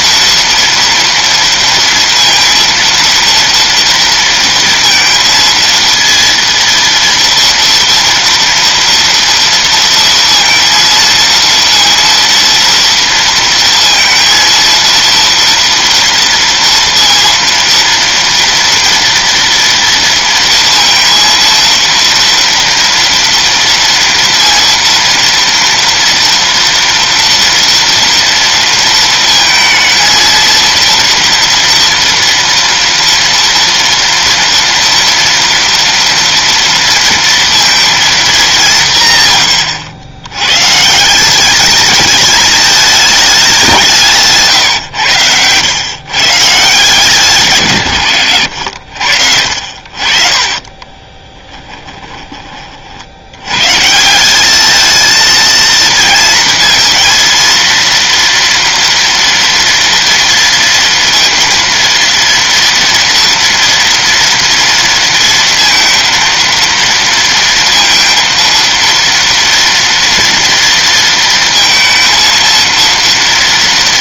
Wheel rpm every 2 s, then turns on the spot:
230, 230, 230, 230, 230, 230, 230, 230, 230, 230, 230, 230, 230, 230, 230, 230, 230, 230, 230, 200, 120, 220, 140, 150, 100, 40, 30, 210, 230, 230, 230, 230, 230, 230, 230, 230, 230.
48-52